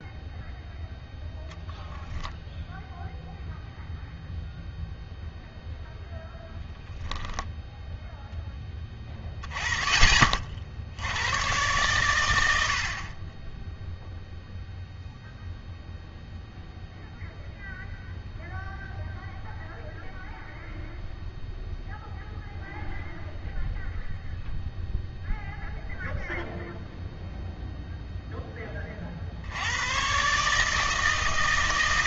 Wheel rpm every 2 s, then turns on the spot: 0, 0, 0, 10, 20, 50, 80, 0, 0, 0, 0, 0, 0, 0, 20, 150.
none